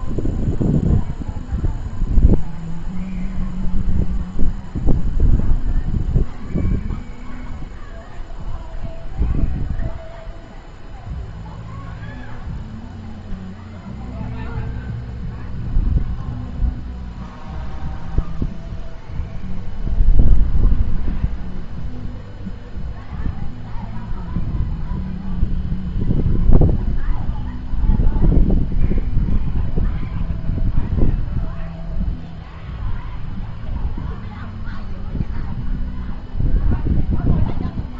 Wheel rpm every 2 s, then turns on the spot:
0, 0, 0, 0, 0, 0, 0, 0, 0, 0, 0, 0, 0, 0, 0, 0, 0, 0, 0.
none